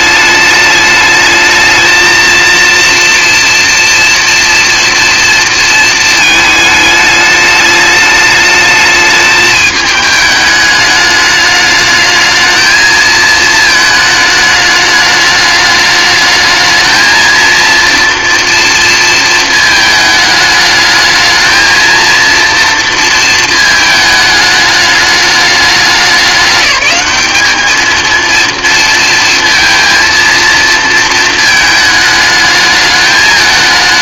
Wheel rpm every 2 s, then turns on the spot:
210, 230, 230, 210, 210, 210, 220, 220, 220, 230, 220, 230, 210, 210, 230, 230, 210.
none